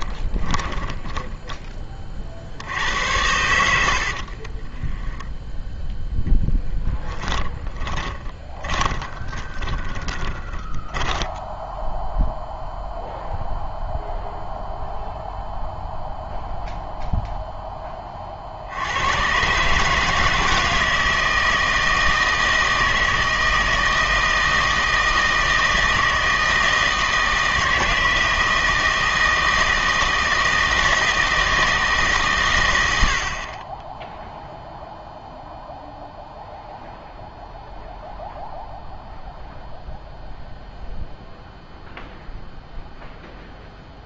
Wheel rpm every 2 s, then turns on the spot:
10, 70, 40, 10, 30, 10, 0, 0, 0, 60, 160, 160, 160, 160, 160, 160, 120, 0, 0, 0, 0, 0.
0-2 4-12